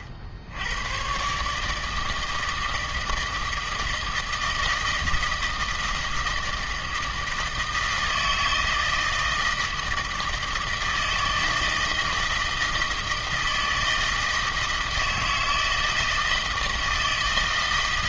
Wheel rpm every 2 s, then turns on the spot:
80, 160, 160, 160, 160, 160, 160, 160, 160.
none